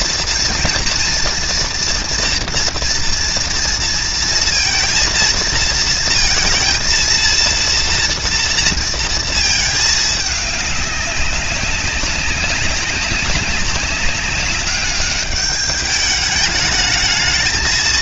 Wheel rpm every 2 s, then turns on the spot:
240, 230, 230, 230, 230, 200, 200, 200, 210.
none